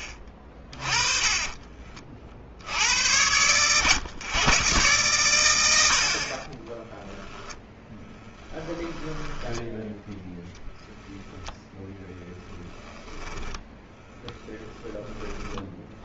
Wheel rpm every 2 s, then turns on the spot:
20, 80, 100, 10, 10, 0, 10, 20.
6-10 12-16